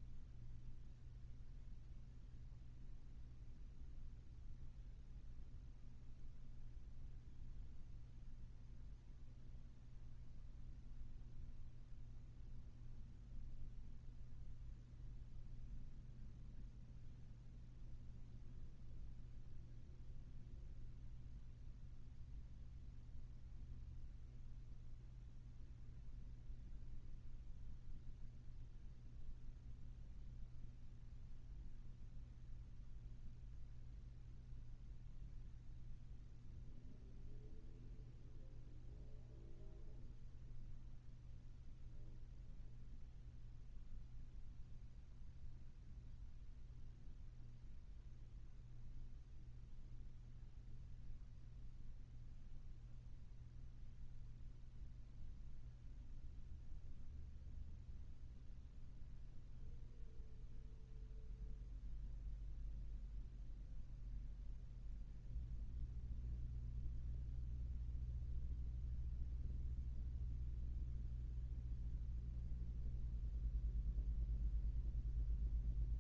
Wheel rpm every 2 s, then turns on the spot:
0, 0, 0, 0, 0, 0, 0, 0, 0, 0, 0, 0, 0, 0, 0, 0, 0, 0, 0, 0, 0, 0, 0, 0, 0, 0, 0, 0, 0, 0, 0, 0, 0, 0, 0, 0, 0, 0.
none